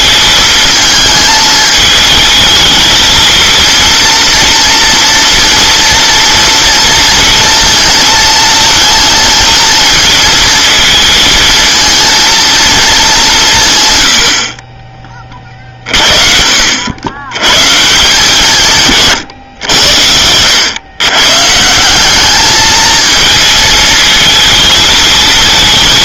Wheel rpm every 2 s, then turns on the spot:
220, 220, 230, 230, 230, 220, 210, 30, 90, 140, 110, 220, 220.
none